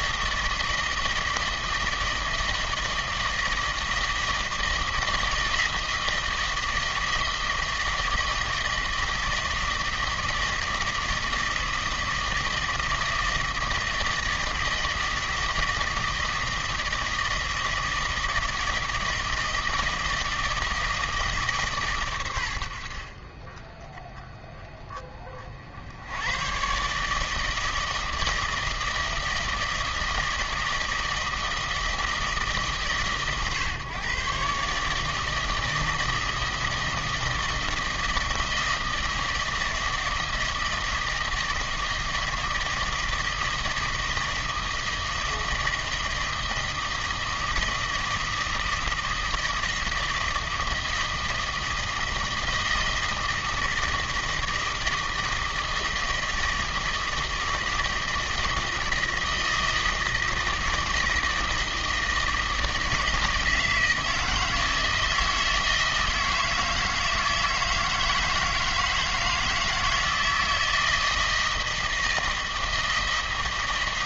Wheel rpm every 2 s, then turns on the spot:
160, 160, 160, 160, 160, 160, 160, 160, 160, 160, 160, 60, 30, 140, 160, 160, 140, 150, 160, 160, 160, 160, 160, 160, 160, 160, 160, 160, 160, 160, 160, 160, 160, 160, 160, 160, 160.
none